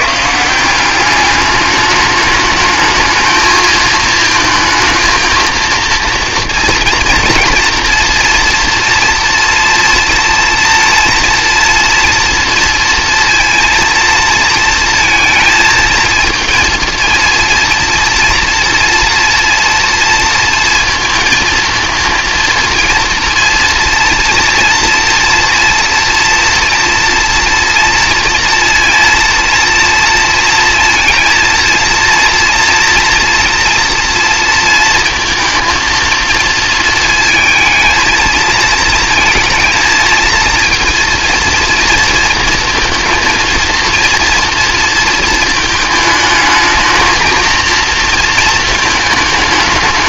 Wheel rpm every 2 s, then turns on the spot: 170, 210, 220, 230, 230, 230, 230, 230, 230, 240, 230, 230, 230, 230, 230, 230, 230, 230, 230, 230, 230, 230, 230, 210, 230.
none